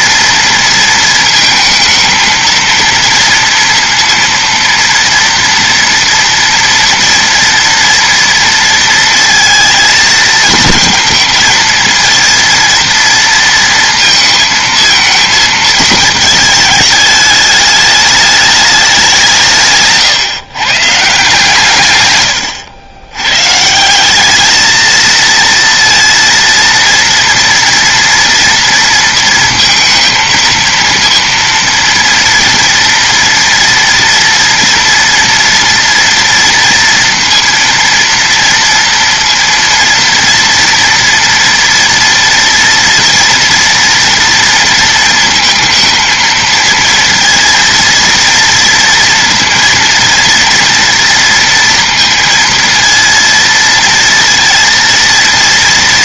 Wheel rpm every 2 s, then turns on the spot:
230, 230, 230, 230, 230, 230, 230, 230, 220, 210, 140, 100, 220, 230, 230, 230, 230, 230, 230, 230, 230, 230, 230, 230, 230, 230, 230, 230.
none